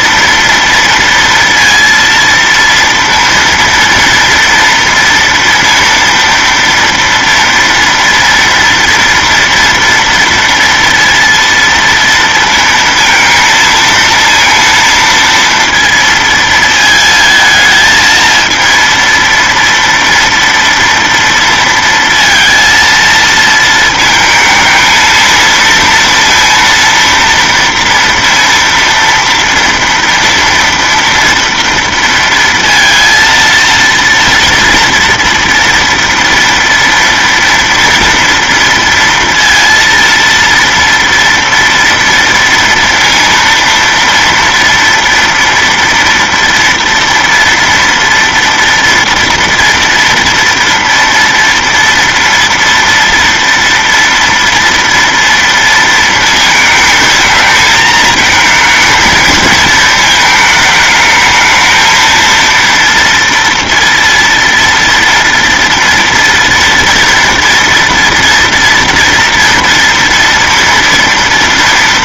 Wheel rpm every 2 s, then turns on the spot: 230, 230, 230, 230, 230, 230, 230, 230, 220, 230, 230, 230, 220, 230, 230, 230, 230, 230, 230, 230, 230, 230, 230, 230, 230, 230, 230, 230, 220, 220, 220, 230, 230, 240, 230, 230.
none